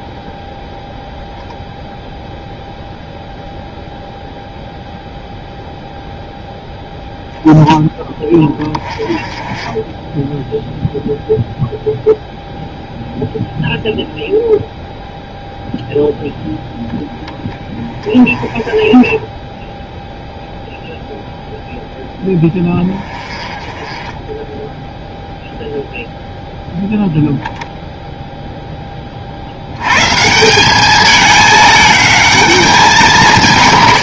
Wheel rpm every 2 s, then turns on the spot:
0, 0, 0, 10, 20, 0, 0, 0, 10, 10, 0, 20, 0, 0, 20, 210, 190.
none